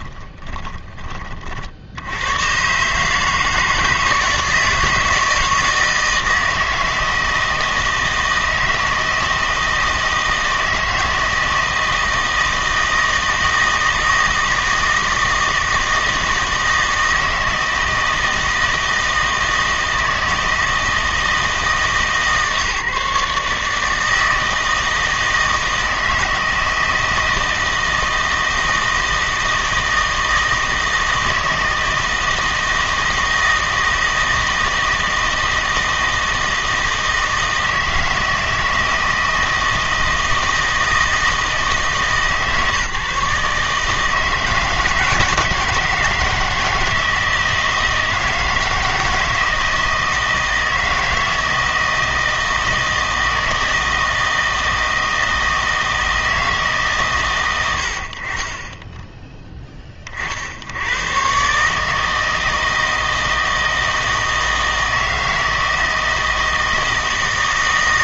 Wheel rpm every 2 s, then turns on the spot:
20, 140, 160, 160, 160, 160, 160, 160, 160, 160, 160, 150, 160, 160, 160, 160, 160, 160, 160, 160, 160, 140, 160, 160, 160, 160, 160, 160, 150, 20, 80, 160, 160, 160.
0-2